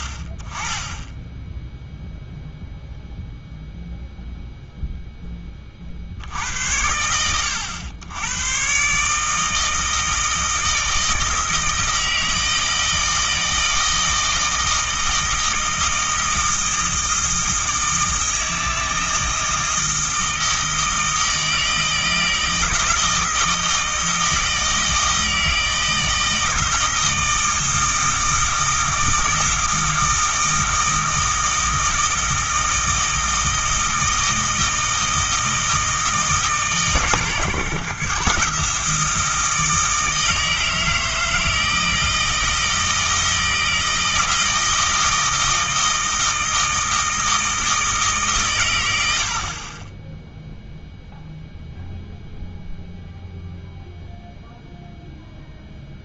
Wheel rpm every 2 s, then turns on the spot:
20, 0, 0, 80, 120, 160, 160, 160, 160, 160, 160, 160, 160, 160, 160, 160, 160, 160, 140, 160, 160, 160, 160, 160, 110, 0, 0, 0.
none